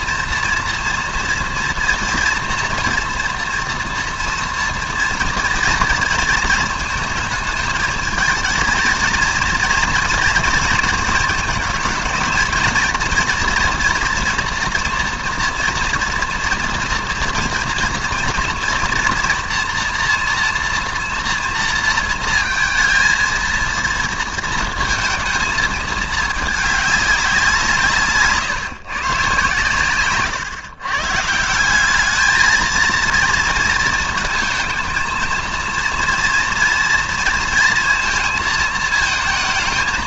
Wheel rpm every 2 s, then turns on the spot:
230, 230, 230, 220, 230, 230, 230, 230, 230, 230, 240, 230, 220, 210, 150, 130, 230, 220, 230, 220.
none